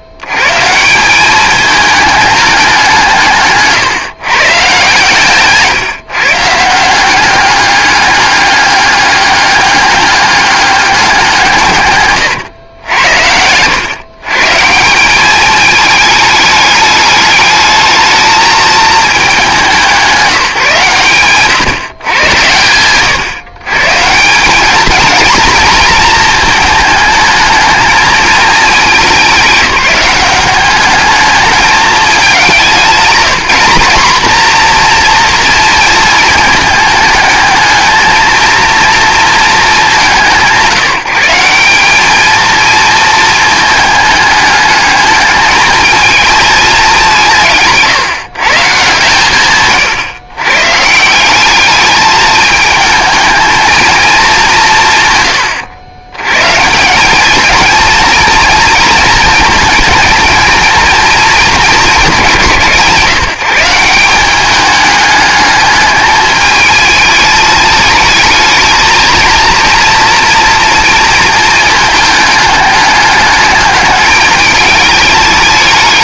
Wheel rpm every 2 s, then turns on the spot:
160, 200, 140, 170, 200, 200, 100, 160, 210, 220, 140, 120, 210, 220, 210, 200, 190, 240, 220, 220, 180, 220, 210, 210, 150, 140, 220, 170, 150, 230, 230, 160, 210, 220, 230, 230, 210, 210.
none